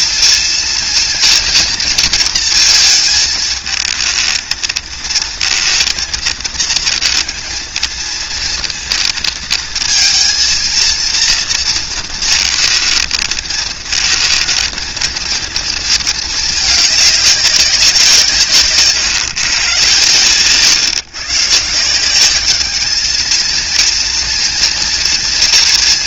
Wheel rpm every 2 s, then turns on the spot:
230, 230, 220, 230, 230, 230, 220, 230, 210, 150, 130, 200, 230.
none